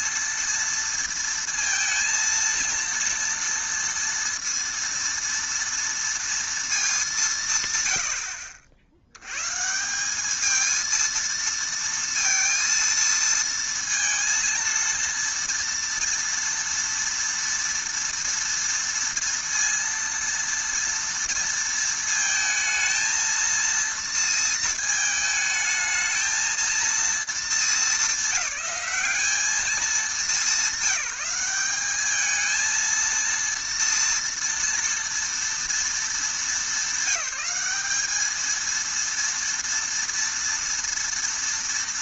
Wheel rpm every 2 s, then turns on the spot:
230, 230, 230, 210, 70, 220, 230, 230, 230, 230, 230, 220, 220, 230, 200, 200, 230, 240, 210, 230, 230.
none